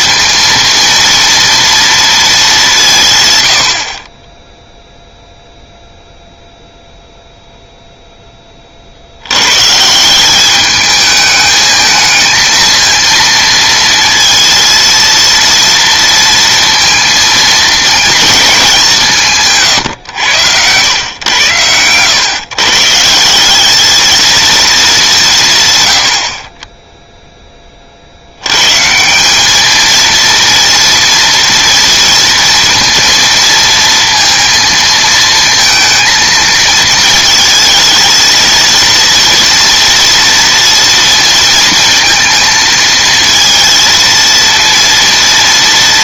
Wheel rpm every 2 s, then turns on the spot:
230, 190, 0, 0, 30, 210, 230, 230, 230, 200, 90, 140, 220, 30, 120, 240, 230, 230, 230, 230, 230, 220, 230.
none